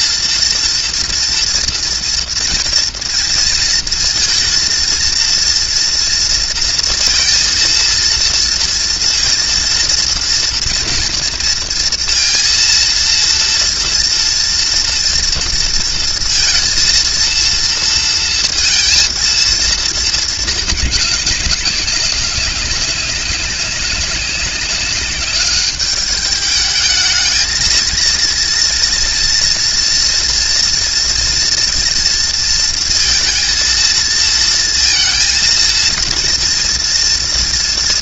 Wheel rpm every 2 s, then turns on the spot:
230, 230, 230, 230, 230, 230, 230, 230, 230, 230, 200, 200, 200, 230, 230, 230, 230, 230, 240.
none